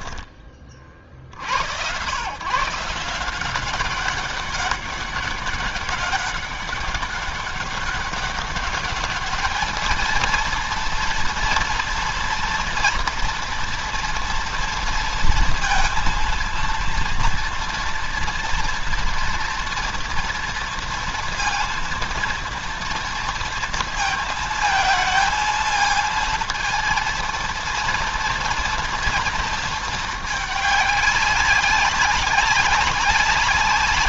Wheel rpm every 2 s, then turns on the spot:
20, 120, 190, 200, 200, 230, 230, 230, 230, 230, 230, 230, 220, 220, 230, 220, 200.
none